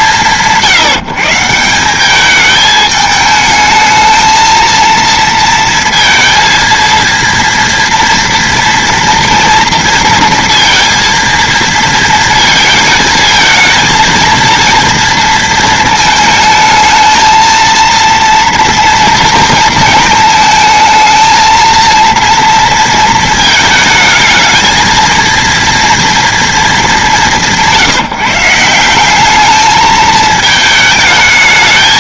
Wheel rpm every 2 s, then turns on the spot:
170, 210, 230, 230, 230, 230, 220, 230, 220, 230, 220, 230, 230, 210, 180, 220.
none